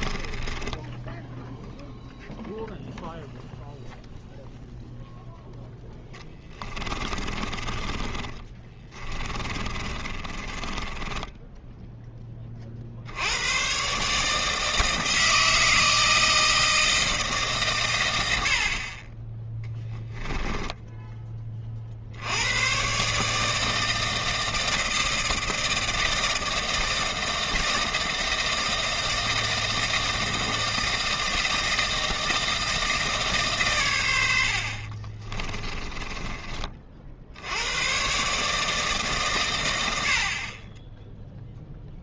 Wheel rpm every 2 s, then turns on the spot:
20, 0, 0, 20, 20, 30, 30, 160, 160, 70, 20, 100, 160, 160, 160, 160, 160, 60, 30, 150, 40.
0-2 6-12 20-22